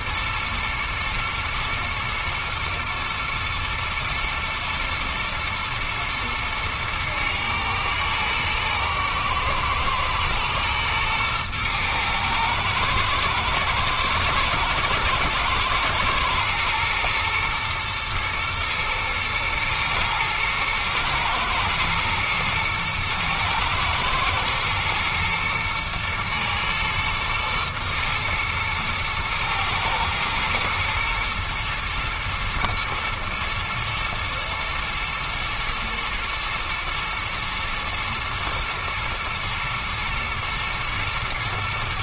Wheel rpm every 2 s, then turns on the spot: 120, 120, 110, 110, 110, 120, 110, 110, 110, 110, 120, 110, 110, 110, 110, 120, 120, 120, 110, 110, 120.
none